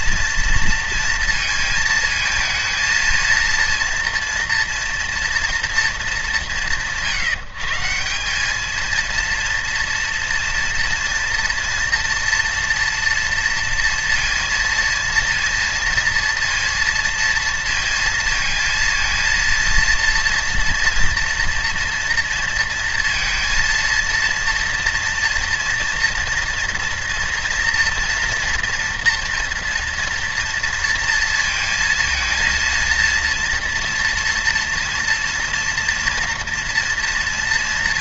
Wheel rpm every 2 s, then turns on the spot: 230, 220, 230, 150, 210, 230, 230, 230, 230, 230, 230, 230, 230, 230, 230, 230, 230, 230, 230.
none